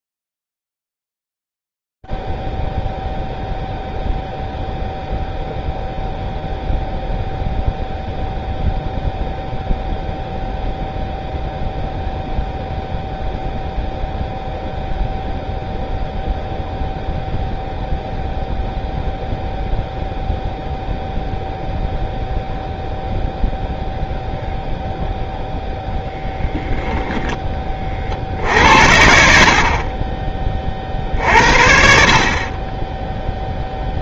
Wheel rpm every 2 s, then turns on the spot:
20, 10, 0, 0, 0, 0, 0, 0, 0, 0, 0, 0, 0, 10, 50, 40, 40.
none